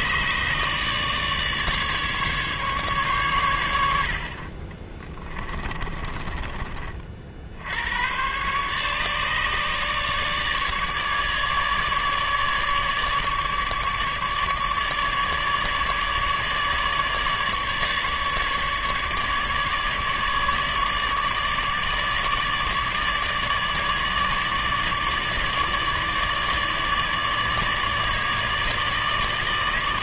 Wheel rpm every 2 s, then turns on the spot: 150, 140, 30, 20, 140, 150, 150, 150, 150, 150, 150, 150, 150, 150, 150.
none